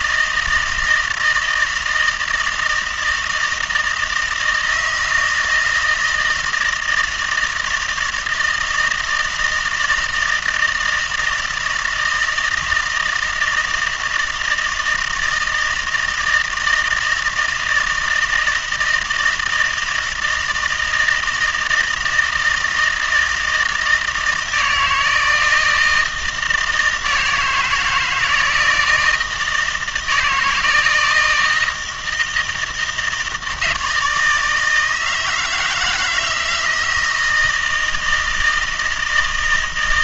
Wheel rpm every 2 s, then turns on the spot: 160, 160, 160, 160, 160, 160, 160, 160, 160, 160, 160, 160, 160, 160, 170, 160, 160, 160, 160, 160.
none